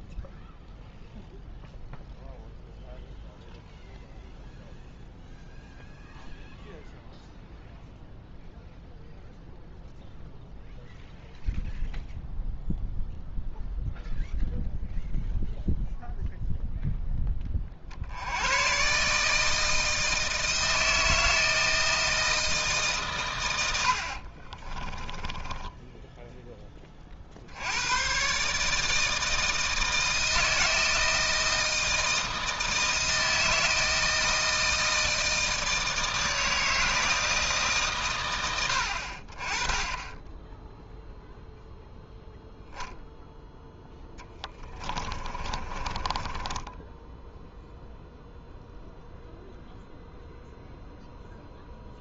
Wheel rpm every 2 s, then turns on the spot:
0, 0, 0, 0, 0, 0, 0, 0, 0, 120, 160, 150, 40, 20, 150, 160, 160, 160, 160, 80, 10, 0, 20, 10, 0, 0.
24-26 44-48